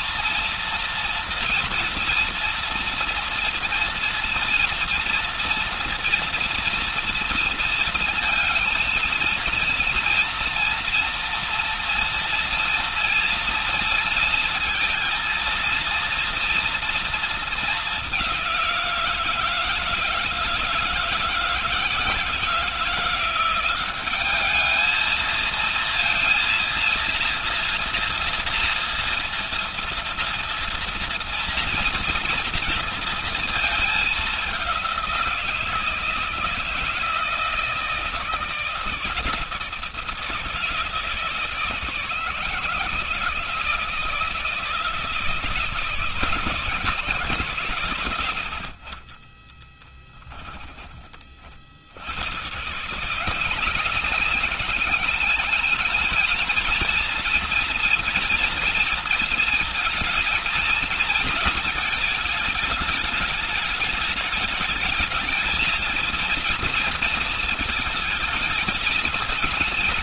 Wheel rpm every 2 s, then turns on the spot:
230, 230, 230, 230, 230, 230, 230, 230, 230, 190, 160, 160, 210, 230, 230, 230, 230, 200, 170, 160, 160, 150, 160, 160, 90, 20, 120, 190, 220, 230, 220, 220, 210, 230, 210.
48-50